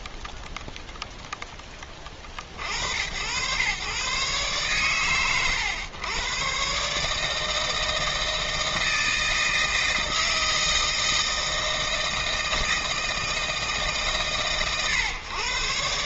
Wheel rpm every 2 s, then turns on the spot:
0, 70, 110, 130, 160, 160, 160, 110.
none